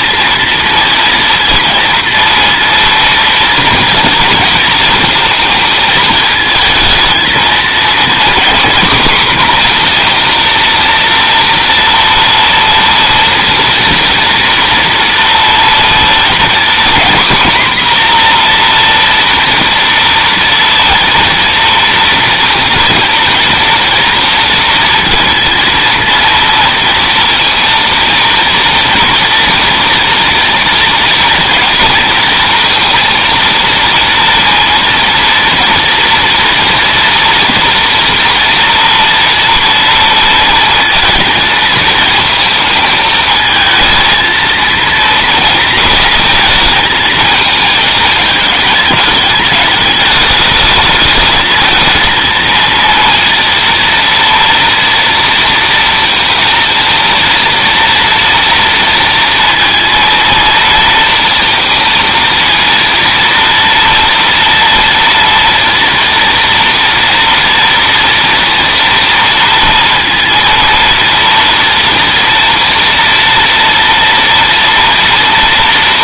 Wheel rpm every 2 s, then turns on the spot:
230, 230, 230, 220, 230, 240, 230, 230, 240, 240, 230, 230, 230, 230, 230, 230, 230, 230, 230, 230, 230, 220, 220, 230, 220, 210, 220, 230, 230, 230, 230, 230, 230, 230, 230, 230, 230, 230.
none